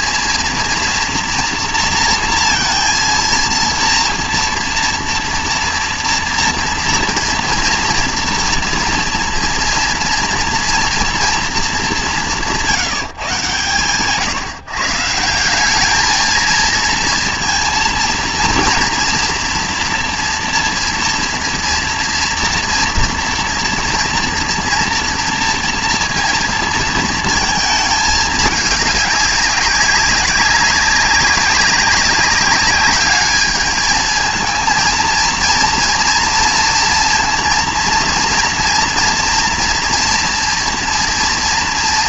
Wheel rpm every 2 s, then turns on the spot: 230, 230, 230, 240, 230, 230, 170, 150, 230, 230, 230, 230, 230, 230, 210, 200, 200, 230, 230, 230, 230.
none